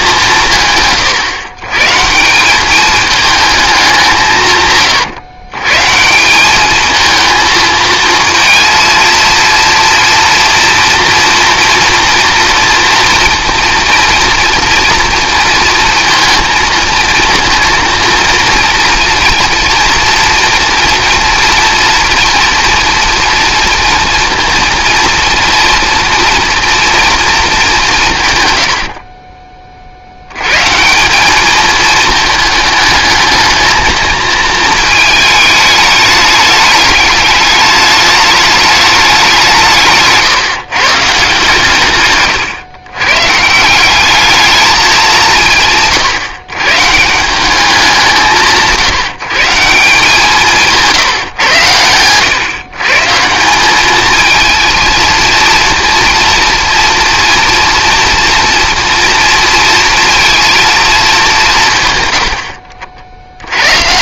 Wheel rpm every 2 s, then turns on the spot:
150, 200, 130, 210, 230, 230, 230, 230, 230, 230, 240, 230, 230, 240, 90, 150, 220, 220, 210, 210, 150, 120, 210, 140, 160, 160, 130, 220, 230, 230, 230, 60.
62-64